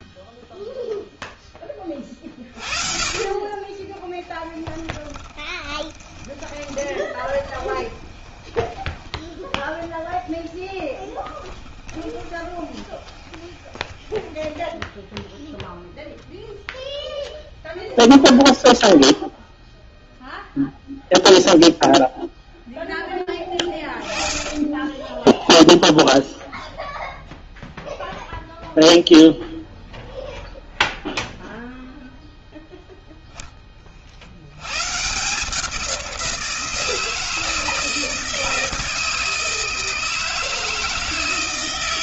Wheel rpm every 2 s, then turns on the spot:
0, 40, 10, 20, 10, 0, 20, 10, 0, 10, 0, 20, 20, 0, 0, 0, 0, 110, 170, 160, 160.
2-10 12-16